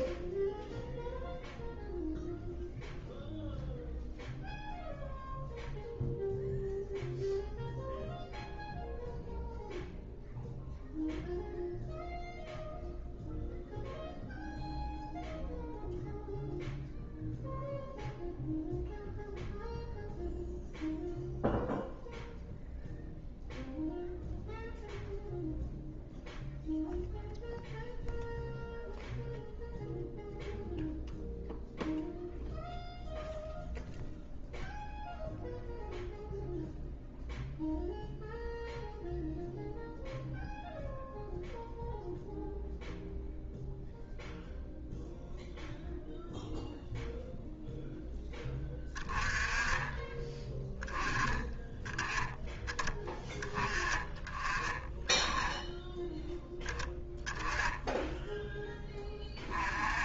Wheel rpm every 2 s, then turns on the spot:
0, 0, 0, 0, 0, 0, 0, 0, 0, 0, 0, 0, 0, 0, 0, 0, 0, 0, 0, 0, 0, 0, 0, 0, 20, 10, 20, 30, 10, 10.
none